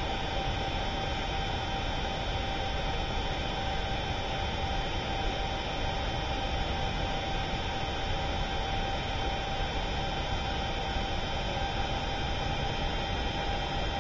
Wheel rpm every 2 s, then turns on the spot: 0, 0, 0, 0, 0, 0, 0.
none